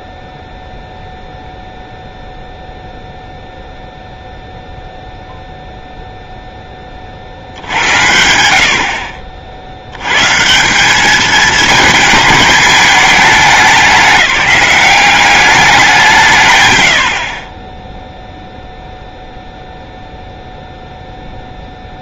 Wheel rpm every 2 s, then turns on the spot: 0, 0, 0, 20, 70, 190, 210, 190, 140, 0, 0.
none